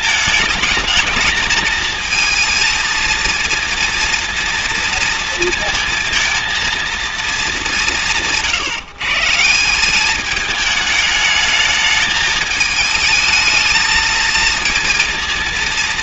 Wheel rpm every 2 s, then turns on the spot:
220, 230, 230, 220, 150, 210, 210, 230.
none